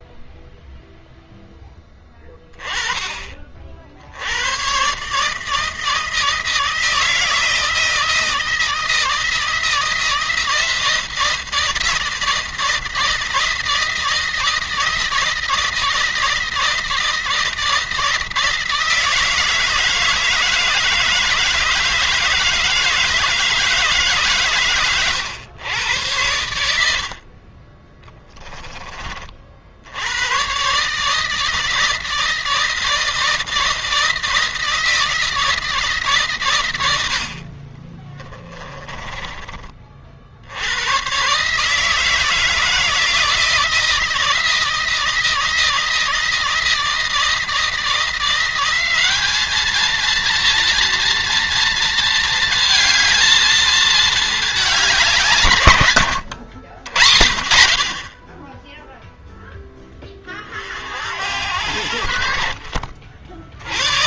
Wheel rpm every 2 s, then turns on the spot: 0, 30, 110, 160, 160, 170, 160, 160, 160, 160, 160, 160, 130, 80, 20, 120, 160, 160, 130, 30, 80, 160, 170, 160, 180, 230, 220, 210, 90, 10, 40, 50.
38-40 56-58